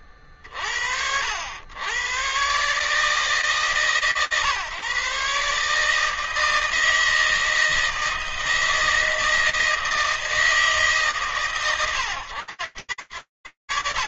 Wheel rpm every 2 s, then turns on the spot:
50, 120, 130, 160, 160, 160, 90.
none